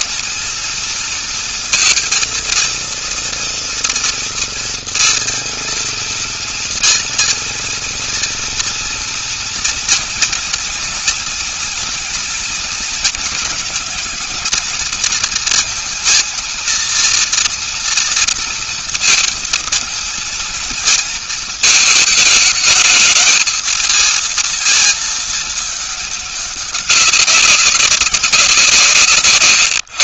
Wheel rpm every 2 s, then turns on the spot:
230, 230, 230, 230, 230, 240, 230, 220, 230, 230, 230, 220, 220, 200, 160.
28-30